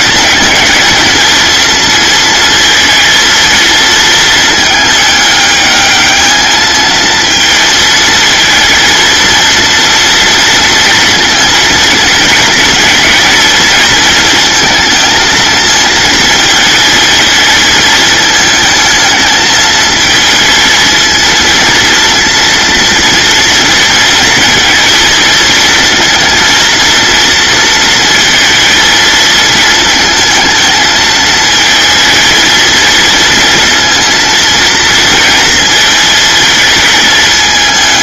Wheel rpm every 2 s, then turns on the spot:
220, 230, 210, 220, 230, 230, 230, 230, 220, 220, 230, 230, 230, 230, 230, 220, 230, 230, 220.
none